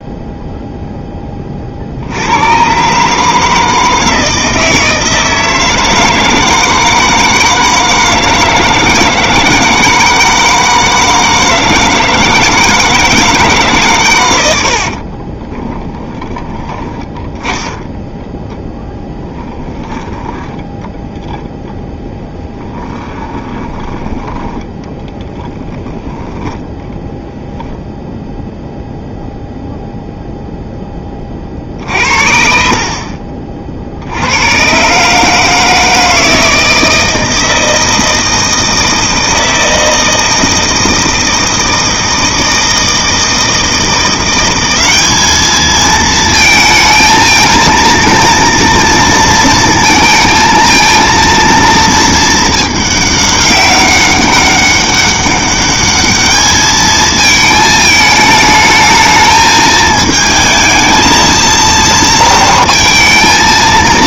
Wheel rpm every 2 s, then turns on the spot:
0, 110, 160, 160, 160, 160, 160, 90, 10, 0, 10, 20, 10, 10, 0, 0, 60, 110, 160, 160, 160, 160, 190, 220, 230, 230, 220, 200, 220, 220, 220, 230.
14-16 22-24 26-28